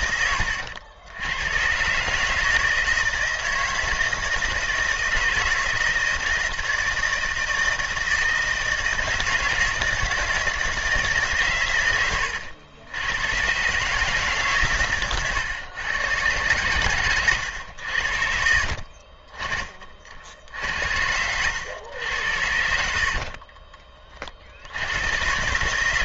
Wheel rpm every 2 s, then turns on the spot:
80, 160, 160, 160, 160, 160, 90, 120, 120, 40, 70, 60, 100.
16-18